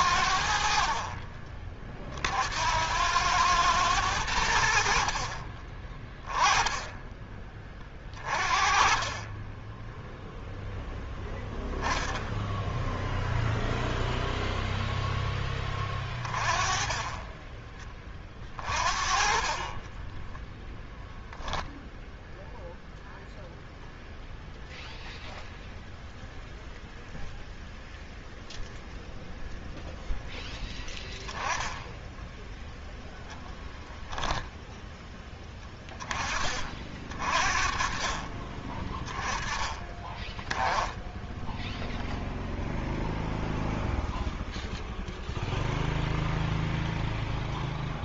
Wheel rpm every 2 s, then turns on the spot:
70, 70, 80, 10, 30, 0, 0, 0, 20, 30, 10, 0, 0, 0, 0, 0, 0, 10, 30, 30, 10, 0, 0, 0.
20-22